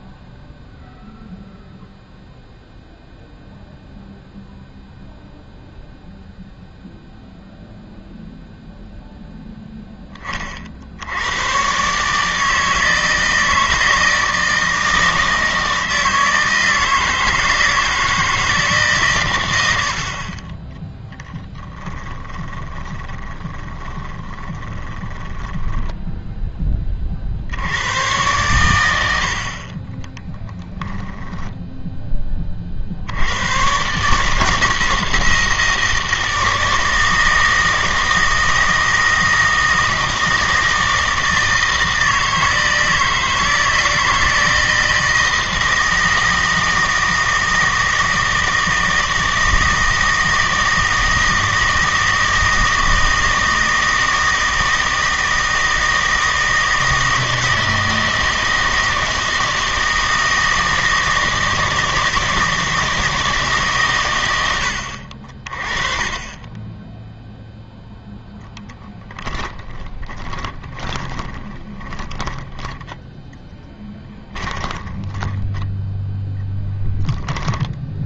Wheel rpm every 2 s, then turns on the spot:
0, 0, 0, 0, 0, 50, 160, 160, 160, 160, 20, 20, 20, 10, 110, 10, 40, 160, 160, 160, 160, 160, 160, 160, 160, 160, 160, 160, 160, 160, 160, 160, 80, 10, 10, 20, 10, 10, 10.
22-26 30-32 70-76